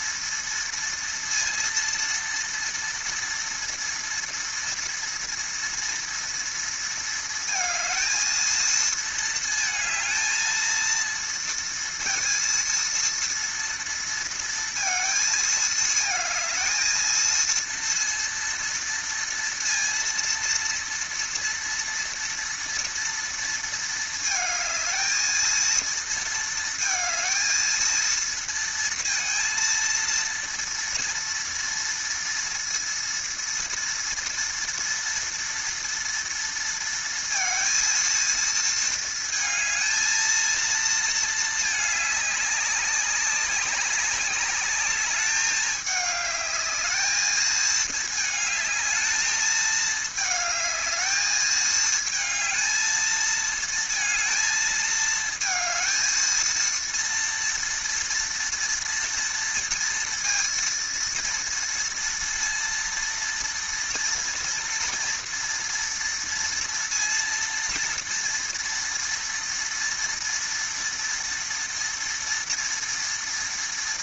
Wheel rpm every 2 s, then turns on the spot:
230, 230, 230, 230, 230, 230, 230, 220, 230, 230, 230, 230, 230, 220, 230, 230, 230, 230, 230, 220, 220, 200, 210, 210, 220, 220, 220, 220, 230, 230, 230, 230, 230, 230, 230, 230, 230.
none